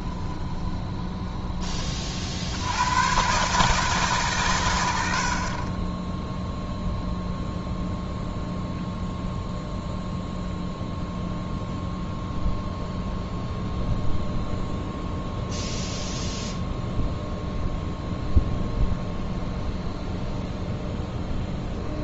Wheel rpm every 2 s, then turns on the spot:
10, 100, 90, 0, 0, 0, 0, 0, 0, 0, 0.
0-2